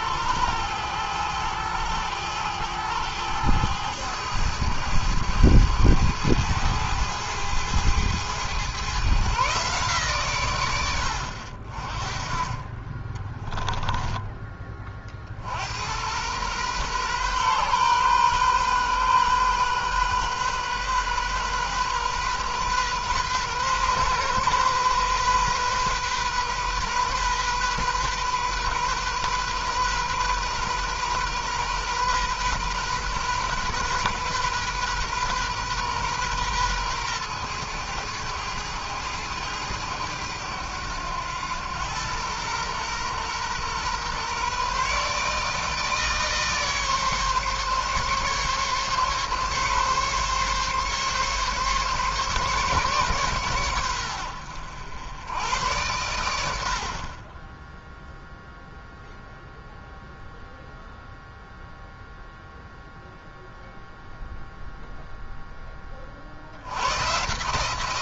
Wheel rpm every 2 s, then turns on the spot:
110, 110, 110, 110, 130, 100, 30, 30, 120, 130, 130, 130, 130, 130, 130, 130, 130, 130, 120, 110, 100, 120, 140, 150, 140, 140, 140, 90, 50, 0, 0, 0, 0, 100.
none